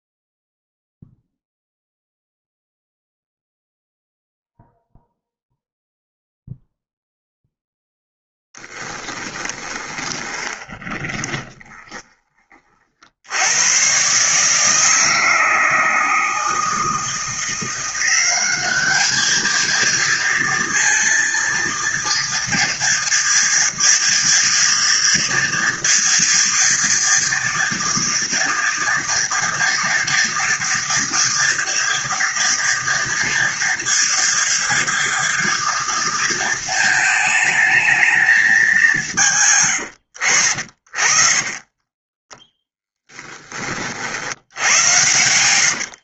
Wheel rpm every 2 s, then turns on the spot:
0, 0, 0, 0, 10, 20, 30, 150, 160, 200, 230, 230, 230, 230, 230, 230, 230, 230, 230, 210, 70, 10, 90.
8-12 40-46